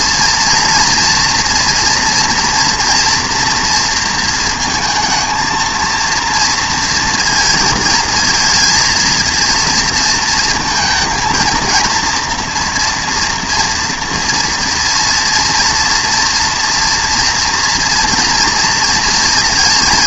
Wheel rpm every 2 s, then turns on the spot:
230, 230, 230, 230, 230, 230, 240, 240, 230, 230.
none